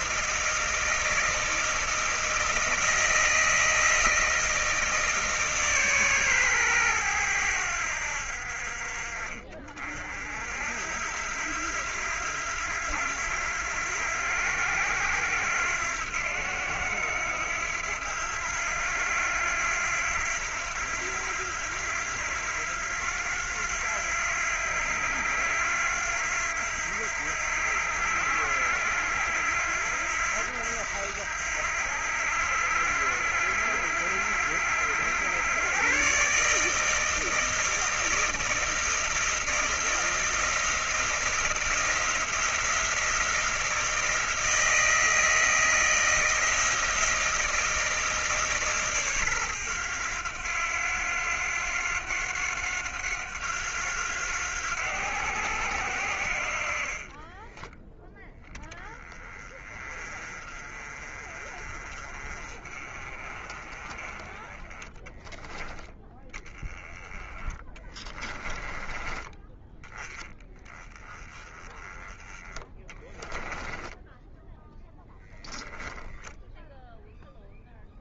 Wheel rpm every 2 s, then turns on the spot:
160, 160, 160, 120, 50, 60, 90, 90, 90, 90, 90, 90, 90, 90, 80, 80, 80, 90, 150, 160, 170, 170, 160, 160, 150, 100, 90, 90, 50, 10, 30, 30, 20, 10, 20, 20, 20, 10, 0.
56-58 72-76